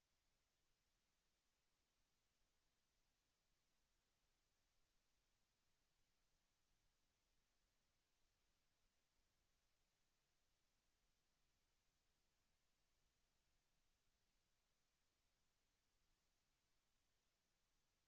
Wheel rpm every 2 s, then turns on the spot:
0, 0, 0, 0, 0, 0, 0, 0, 0.
none